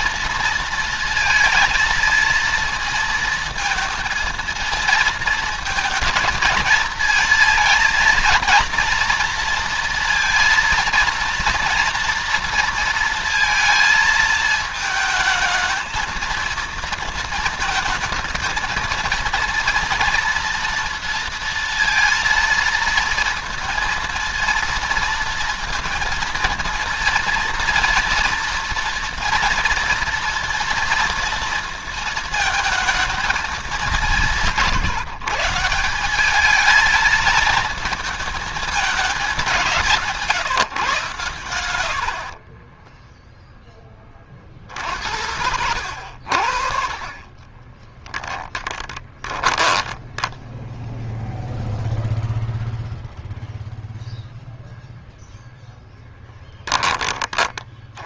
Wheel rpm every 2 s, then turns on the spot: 230, 230, 230, 220, 230, 230, 230, 220, 230, 220, 230, 230, 230, 230, 230, 230, 230, 160, 220, 220, 150, 20, 70, 50, 20, 10, 0, 0, 20.
42-44 48-52